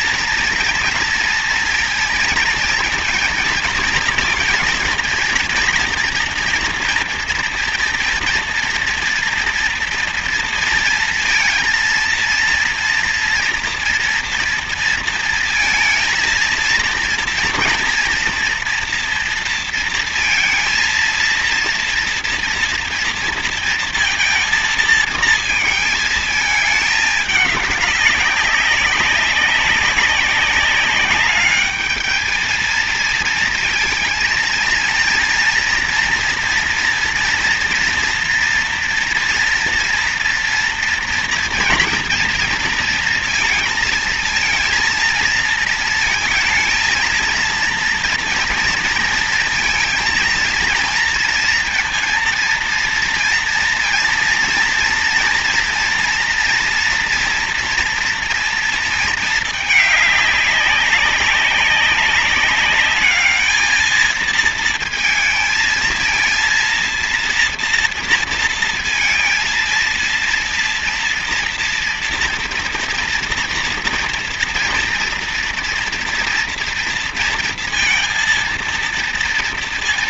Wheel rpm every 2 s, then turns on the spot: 230, 230, 230, 230, 230, 230, 230, 230, 230, 230, 230, 230, 230, 220, 190, 190, 220, 230, 230, 230, 230, 230, 220, 220, 230, 230, 230, 230, 230, 230, 200, 200, 220, 230, 230, 230, 230, 230, 230, 230.
none